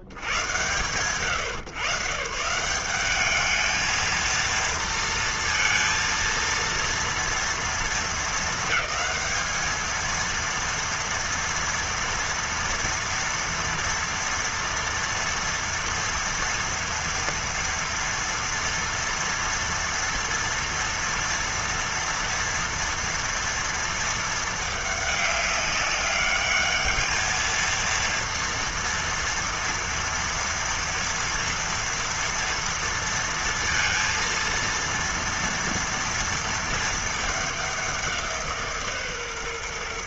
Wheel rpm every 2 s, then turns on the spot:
70, 140, 220, 230, 220, 230, 230, 230, 230, 230, 230, 230, 220, 210, 230, 230, 230, 230, 230, 170.
none